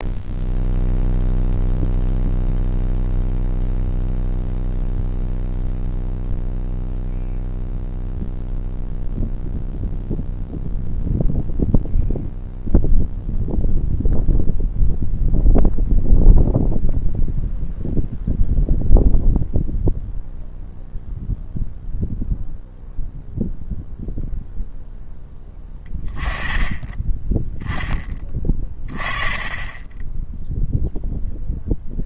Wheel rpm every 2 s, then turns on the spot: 0, 0, 0, 0, 0, 0, 0, 0, 0, 0, 0, 0, 0, 10, 20, 0.
none